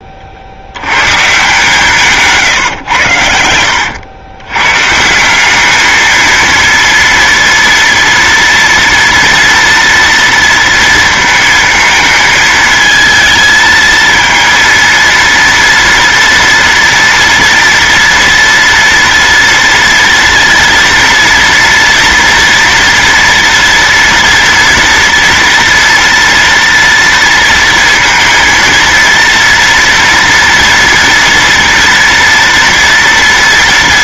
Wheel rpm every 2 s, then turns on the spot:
80, 140, 110, 230, 230, 230, 220, 230, 230, 230, 230, 230, 240, 230, 230, 230, 230.
2-4